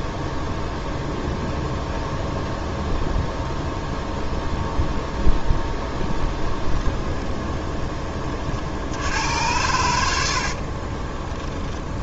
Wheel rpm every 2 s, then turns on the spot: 0, 0, 0, 10, 60, 40.
6-8 10-12